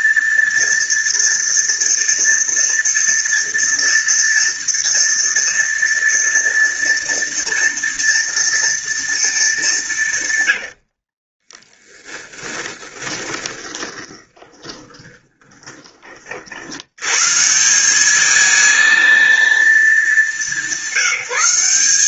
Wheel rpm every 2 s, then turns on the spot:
230, 230, 230, 230, 230, 70, 10, 20, 110, 220, 190.
10-16